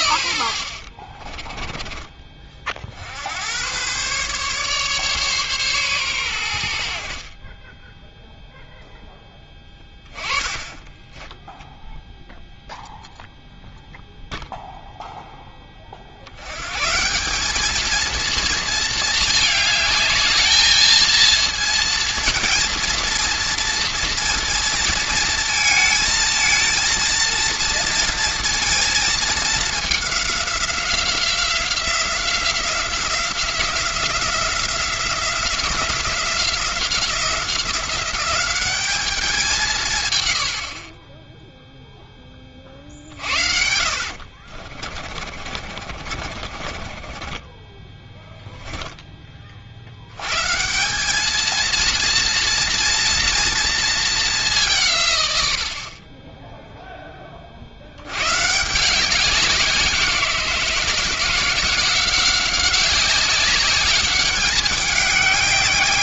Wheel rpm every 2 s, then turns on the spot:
70, 40, 140, 80, 0, 20, 0, 0, 120, 220, 220, 230, 230, 220, 230, 190, 180, 180, 180, 200, 60, 40, 50, 40, 0, 140, 230, 170, 10, 150, 170, 190, 200.
0-2 10-12 44-48